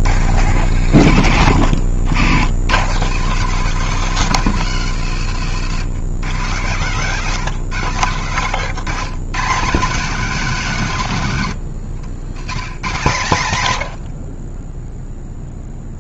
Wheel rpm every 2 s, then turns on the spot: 90, 100, 140, 120, 130, 190, 130, 20.
none